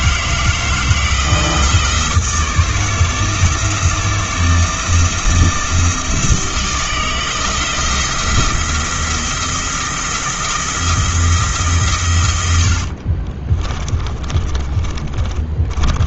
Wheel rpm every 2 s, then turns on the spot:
160, 160, 160, 160, 170, 170, 70, 30.
12-16